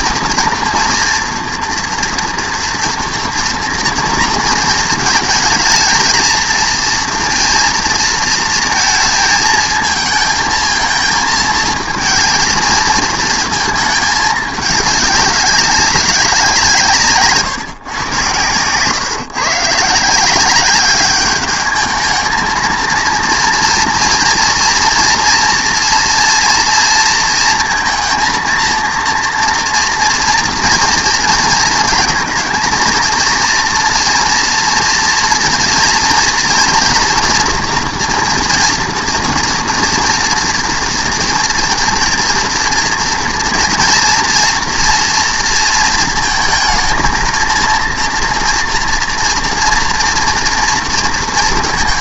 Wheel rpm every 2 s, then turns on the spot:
230, 230, 220, 230, 220, 220, 220, 210, 170, 120, 200, 220, 230, 230, 230, 230, 230, 240, 230, 240, 230, 230, 240, 220, 240, 240.
none